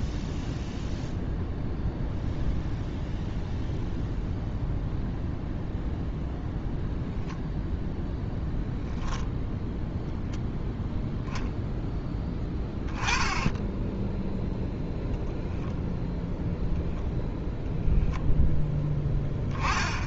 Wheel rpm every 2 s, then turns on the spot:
0, 0, 0, 0, 0, 0, 10, 0, 0, 10.
none